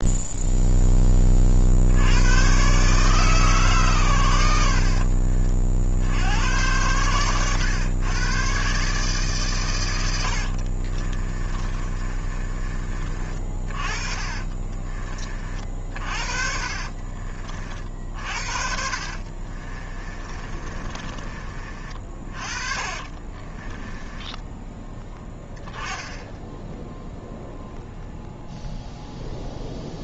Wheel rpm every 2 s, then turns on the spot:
0, 100, 100, 90, 110, 80, 30, 40, 50, 50, 30, 30, 10, 10, 0.
12-22 24-26